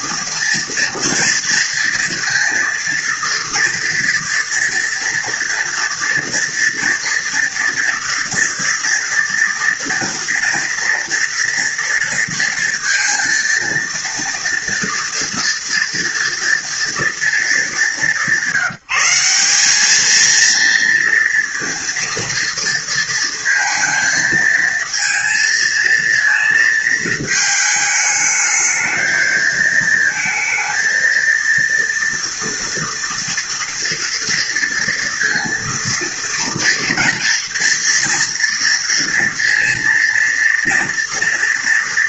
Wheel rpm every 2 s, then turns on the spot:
230, 230, 230, 230, 230, 240, 230, 230, 230, 190, 230, 230, 220, 220, 220, 230, 230, 230, 230, 230, 230.
none